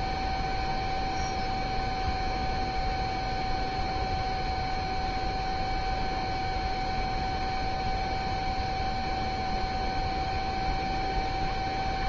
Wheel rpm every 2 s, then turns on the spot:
0, 0, 0, 0, 0, 0.
none